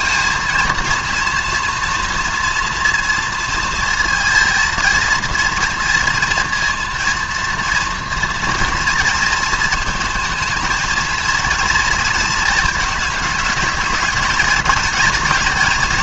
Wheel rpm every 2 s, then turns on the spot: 230, 230, 230, 230, 230, 220, 220, 220.
none